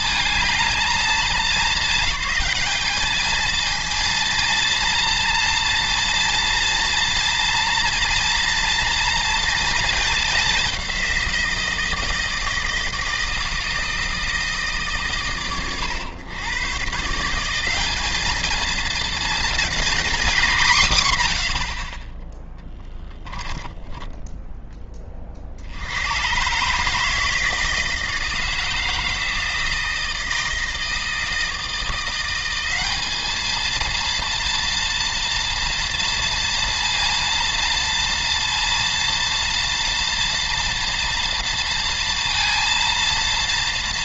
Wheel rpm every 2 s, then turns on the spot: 220, 210, 230, 230, 230, 190, 160, 150, 130, 220, 190, 20, 10, 140, 160, 160, 190, 230, 230, 230, 230, 230.
22-24